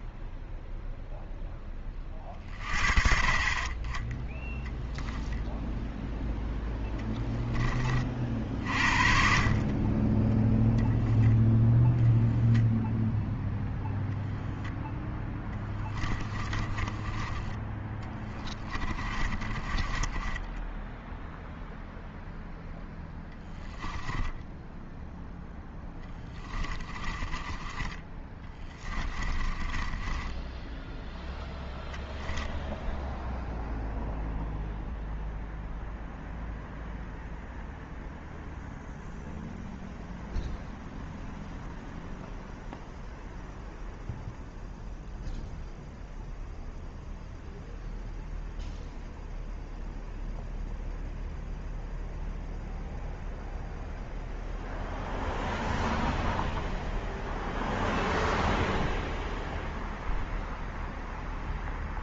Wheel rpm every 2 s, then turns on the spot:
0, 40, 10, 10, 50, 10, 0, 0, 30, 20, 10, 0, 0, 20, 10, 10, 0, 0, 0, 0, 0, 0, 0, 0, 0, 0, 0, 0, 0, 0, 0.
16-22 26-32